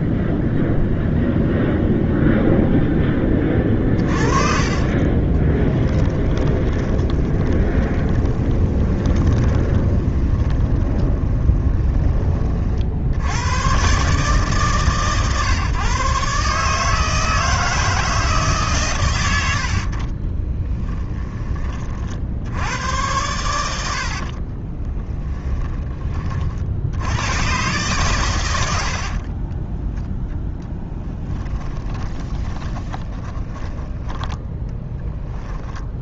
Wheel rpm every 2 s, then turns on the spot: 0, 0, 40, 20, 20, 20, 50, 140, 150, 130, 10, 90, 20, 60, 90, 10, 20, 10.
4-12 20-22 24-26 30-34